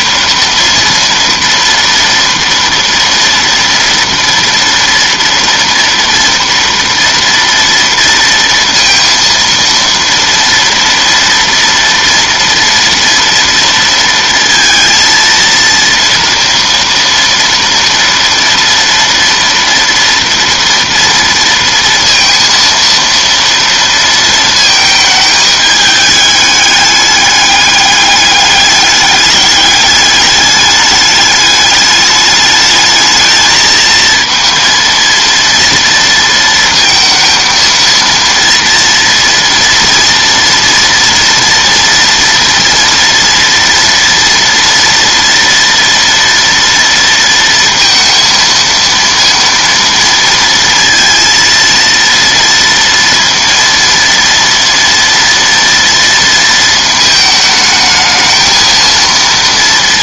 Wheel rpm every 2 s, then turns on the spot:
230, 230, 230, 230, 230, 230, 230, 230, 230, 230, 230, 230, 220, 210, 200, 210, 210, 230, 230, 230, 230, 230, 230, 230, 230, 230, 230, 230, 230, 230.
none